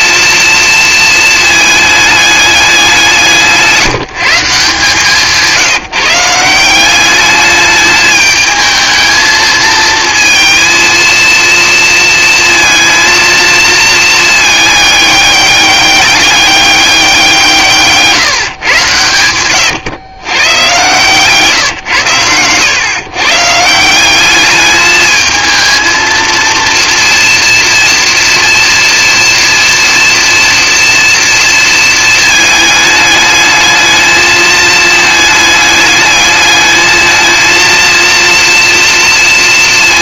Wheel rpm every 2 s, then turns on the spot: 230, 190, 170, 180, 220, 230, 230, 210, 190, 120, 130, 130, 210, 230, 230, 230, 220, 220, 220, 230.
none